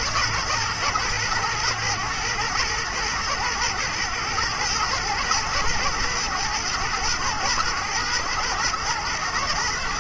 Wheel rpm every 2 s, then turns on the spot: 110, 110, 110, 110, 110.
none